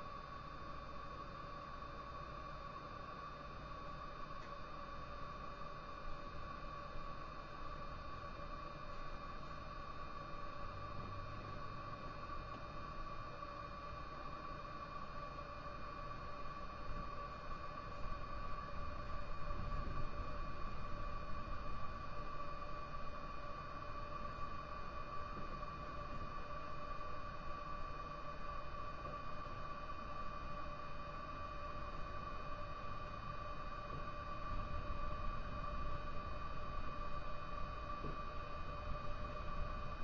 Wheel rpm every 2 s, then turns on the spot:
0, 0, 0, 0, 0, 0, 0, 0, 0, 0, 0, 0, 0, 0, 0, 0, 0, 0, 0, 0.
none